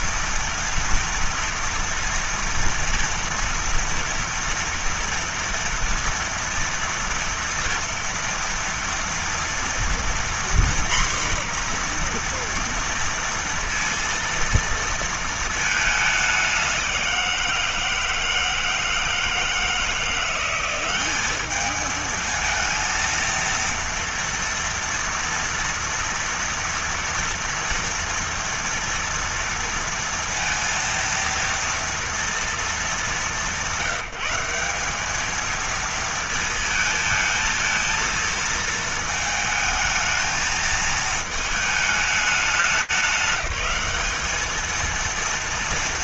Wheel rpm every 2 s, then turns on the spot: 230, 230, 230, 230, 230, 240, 240, 230, 190, 160, 180, 220, 230, 240, 230, 230, 210, 180, 220, 230, 220, 210, 210.
none